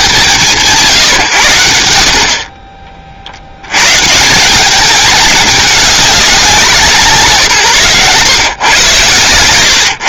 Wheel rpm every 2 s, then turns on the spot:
90, 100, 210, 140, 140.
none